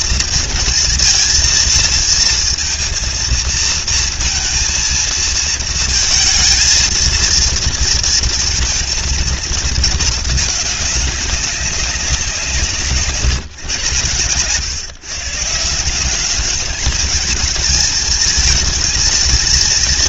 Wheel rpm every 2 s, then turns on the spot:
230, 230, 230, 230, 230, 210, 170, 140, 210, 220.
none